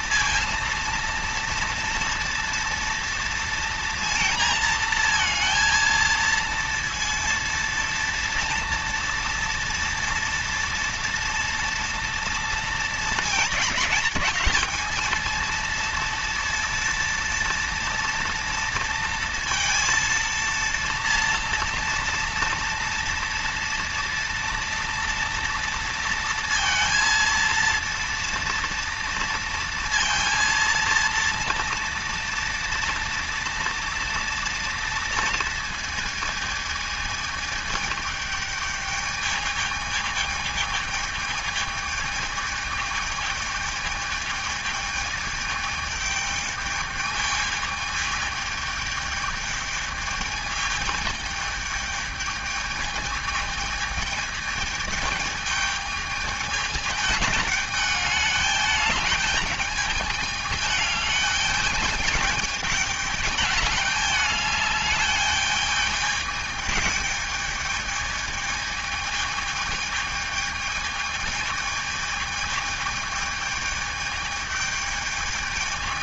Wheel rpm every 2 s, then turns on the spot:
230, 230, 230, 230, 230, 230, 220, 210, 230, 230, 230, 230, 230, 230, 230, 230, 230, 230, 220, 210, 220, 220, 210, 210, 210, 210, 210, 220, 210, 210, 210, 210, 210, 210, 220, 220, 220, 210.
none